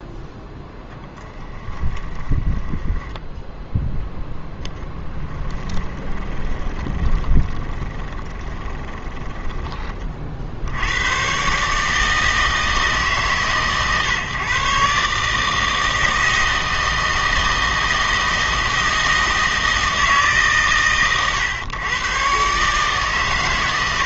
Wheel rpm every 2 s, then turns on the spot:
0, 30, 10, 20, 20, 70, 160, 140, 160, 160, 140, 140.
2-10